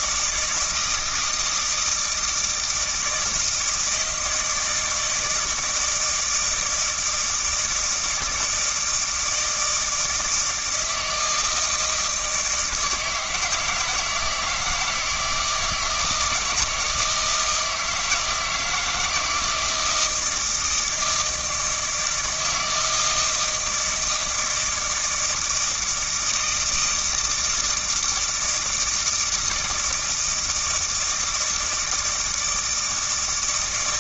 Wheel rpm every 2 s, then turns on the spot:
170, 160, 160, 160, 160, 160, 160, 160, 160, 160, 160, 160, 160, 160, 160, 160, 160.
none